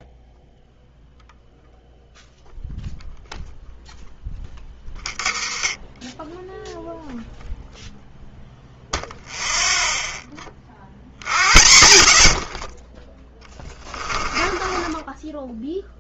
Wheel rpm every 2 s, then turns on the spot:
0, 0, 20, 0, 0, 40, 40, 20.
4-6 12-16